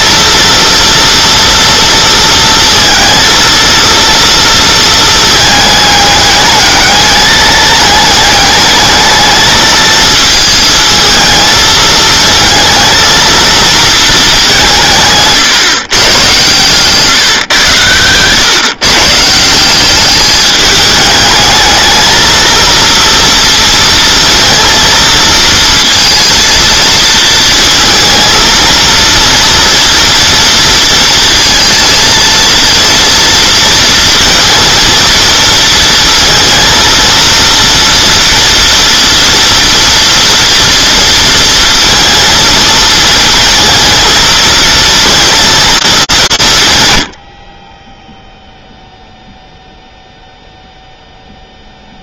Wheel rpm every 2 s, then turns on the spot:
230, 230, 230, 200, 210, 220, 230, 190, 130, 120, 210, 230, 230, 230, 230, 230, 230, 230, 230, 230, 230, 230, 230, 150, 0, 0.
none